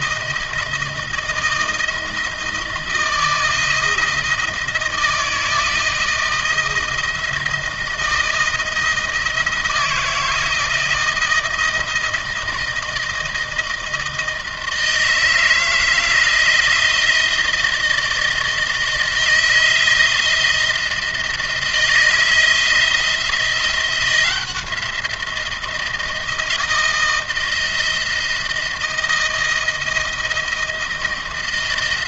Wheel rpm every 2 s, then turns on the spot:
170, 160, 160, 160, 160, 160, 160, 160, 160, 160, 170, 170, 170, 160, 160, 160.
none